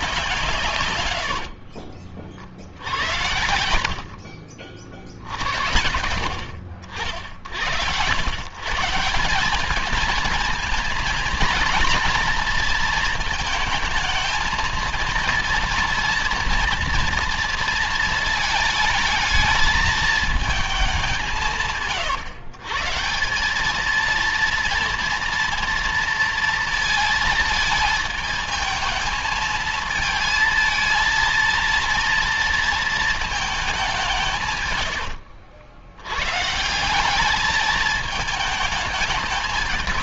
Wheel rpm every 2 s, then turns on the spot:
150, 70, 70, 60, 130, 220, 230, 220, 230, 220, 210, 130, 230, 230, 220, 220, 230, 140, 150, 210.
none